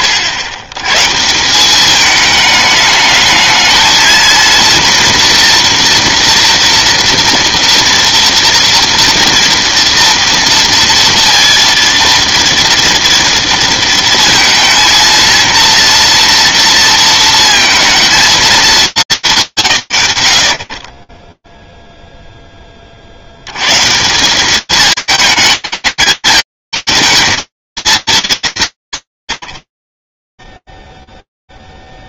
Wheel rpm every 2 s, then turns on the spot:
40, 200, 220, 240, 230, 230, 230, 230, 240, 220, 70, 10, 180, 180, 150, 0.
none